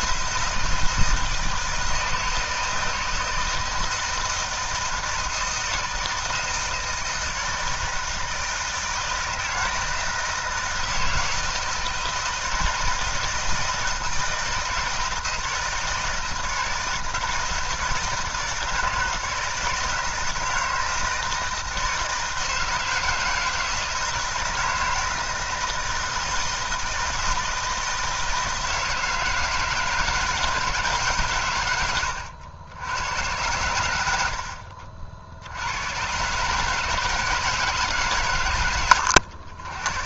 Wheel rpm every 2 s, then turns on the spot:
160, 160, 160, 160, 160, 160, 160, 160, 160, 160, 160, 160, 160, 160, 160, 160, 90, 90, 120, 130.
none